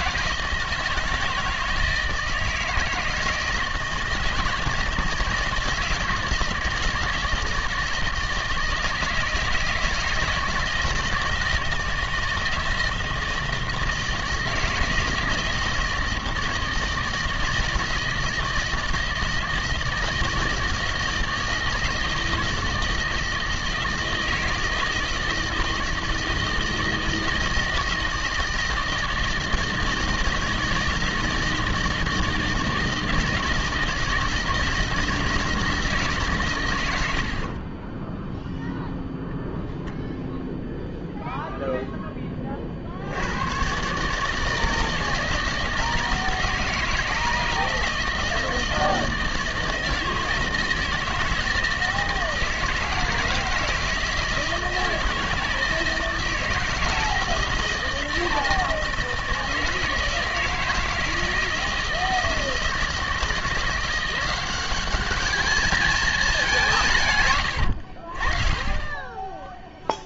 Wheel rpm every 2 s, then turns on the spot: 160, 160, 160, 170, 160, 160, 160, 160, 160, 160, 160, 160, 160, 160, 160, 160, 160, 160, 130, 0, 0, 30, 160, 160, 160, 160, 160, 160, 160, 160, 160, 170, 190, 180, 30.
none